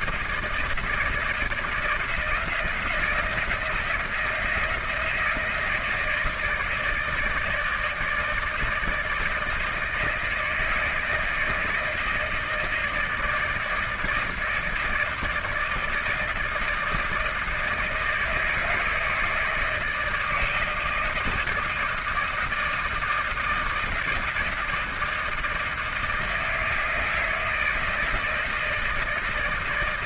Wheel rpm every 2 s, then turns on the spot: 160, 170, 170, 160, 160, 160, 160, 160, 160, 160, 160, 160, 160, 160, 160.
none